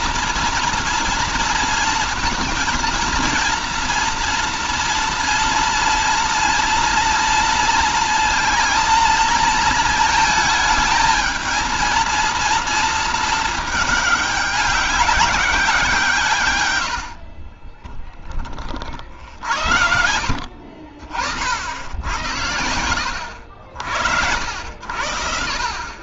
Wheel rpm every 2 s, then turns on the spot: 230, 230, 240, 230, 230, 220, 230, 200, 120, 30, 60, 80, 70.
16-18